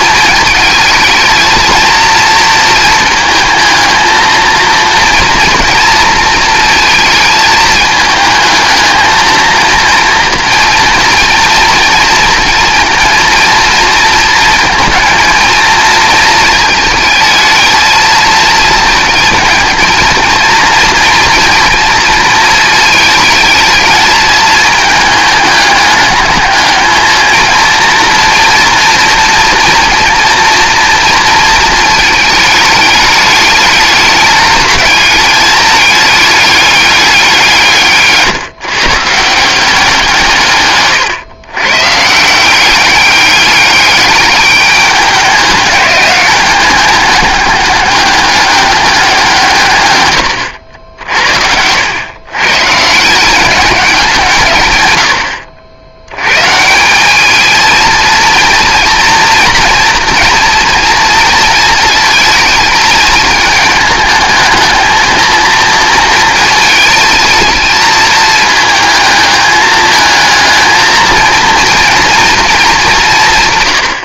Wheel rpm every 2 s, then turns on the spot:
220, 230, 230, 220, 220, 230, 230, 230, 220, 230, 230, 220, 220, 220, 240, 230, 210, 210, 210, 140, 130, 190, 200, 200, 200, 90, 140, 140, 150, 230, 230, 220, 220, 220, 220, 220, 220.
none